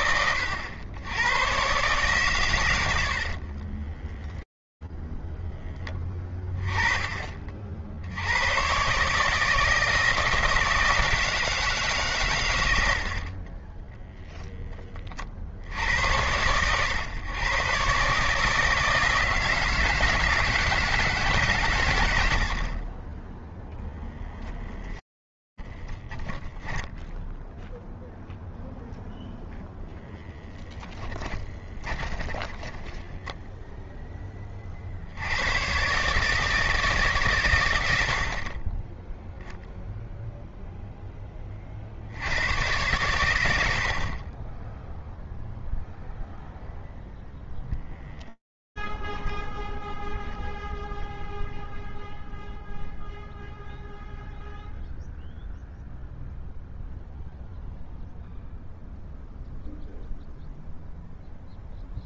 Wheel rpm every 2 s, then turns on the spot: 100, 70, 10, 20, 120, 160, 110, 20, 120, 160, 160, 20, 0, 10, 0, 10, 10, 50, 150, 20, 0, 110, 0, 0, 0, 0, 0, 0, 0, 0, 0.
2-6 26-28 32-34